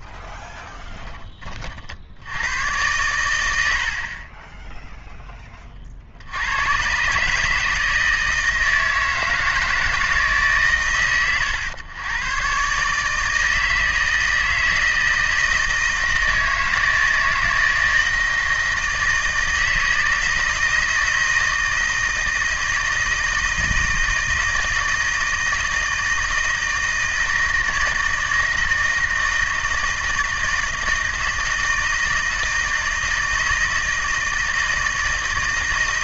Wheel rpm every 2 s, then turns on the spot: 20, 110, 10, 120, 160, 130, 140, 160, 160, 160, 160, 160, 160, 160, 160, 160, 160, 160.
none